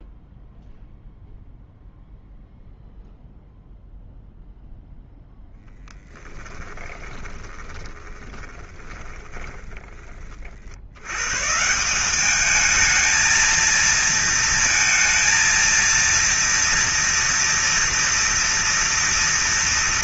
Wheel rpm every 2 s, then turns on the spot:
0, 0, 0, 20, 20, 90, 220, 230, 230, 230.
6-10